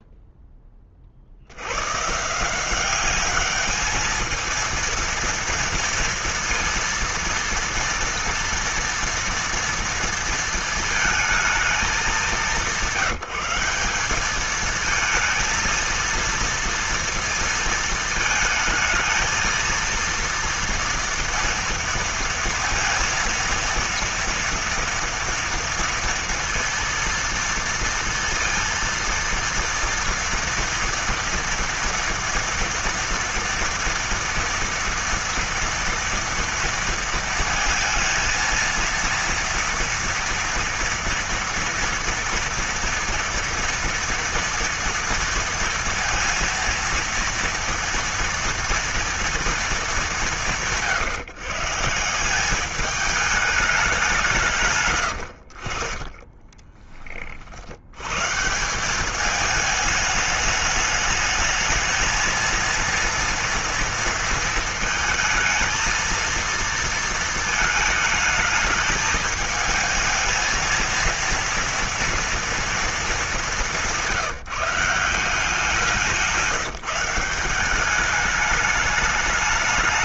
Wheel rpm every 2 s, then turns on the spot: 10, 150, 220, 230, 230, 230, 190, 200, 230, 220, 230, 230, 230, 230, 230, 230, 230, 230, 230, 230, 230, 240, 240, 230, 240, 150, 180, 180, 30, 130, 220, 220, 230, 230, 220, 220, 230, 170, 180, 210.
56-58